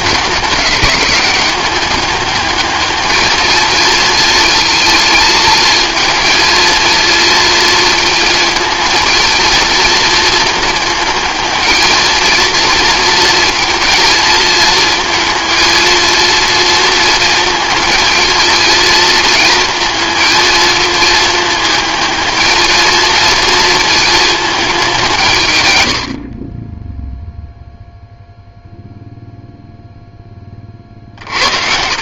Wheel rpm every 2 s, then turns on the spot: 200, 220, 220, 230, 230, 220, 230, 220, 230, 230, 220, 220, 200, 10, 0, 40.
30-32